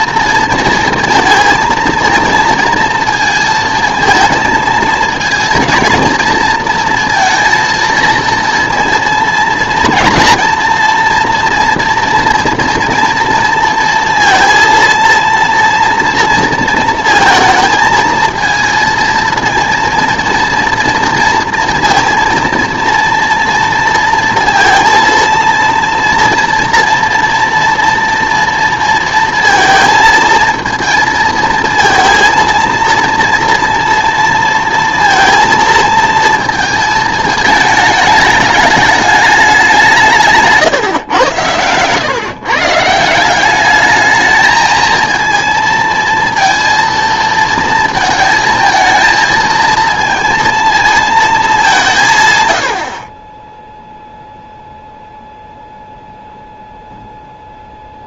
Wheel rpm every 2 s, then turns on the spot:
230, 230, 220, 230, 230, 240, 230, 230, 230, 230, 230, 230, 230, 230, 230, 230, 230, 230, 230, 210, 140, 140, 220, 230, 220, 230, 90, 0, 0.
none